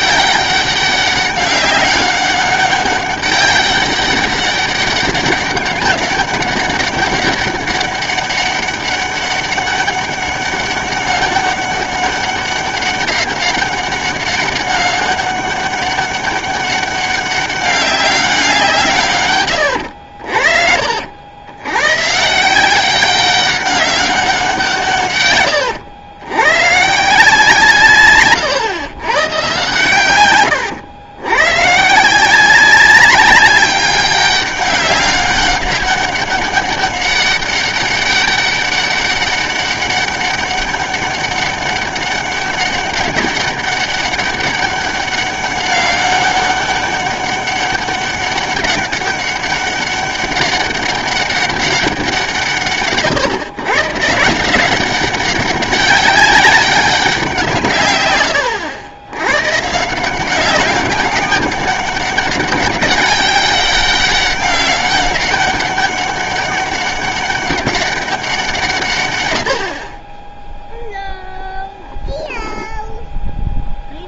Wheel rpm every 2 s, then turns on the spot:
200, 200, 200, 200, 200, 200, 190, 190, 200, 170, 60, 180, 160, 140, 130, 100, 190, 200, 200, 200, 200, 200, 200, 200, 200, 200, 130, 180, 200, 90, 190, 200, 200, 200, 150, 0, 0.
none